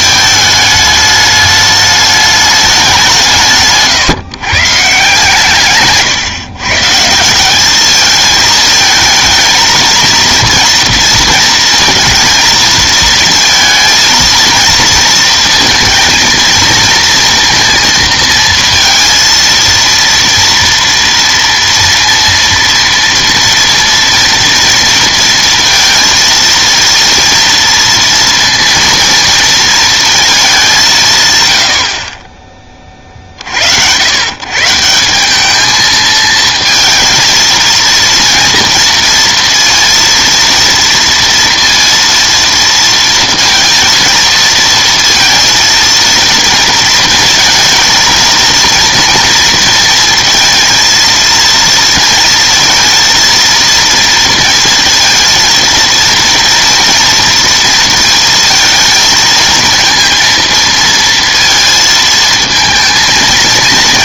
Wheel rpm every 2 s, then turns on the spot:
220, 200, 150, 140, 220, 230, 220, 230, 230, 230, 230, 230, 230, 230, 230, 210, 40, 150, 230, 230, 230, 230, 230, 230, 230, 230, 230, 220, 230, 230, 230, 230.
none